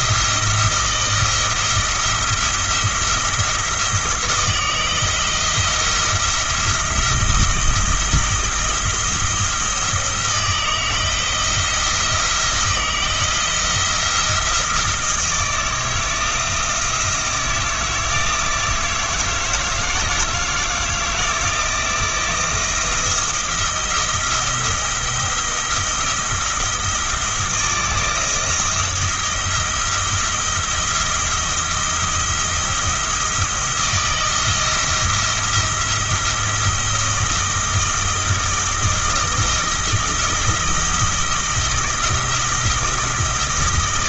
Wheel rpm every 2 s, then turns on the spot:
160, 170, 160, 170, 170, 170, 170, 170, 160, 160, 160, 170, 170, 170, 160, 170, 170, 170, 160, 160, 160, 170.
none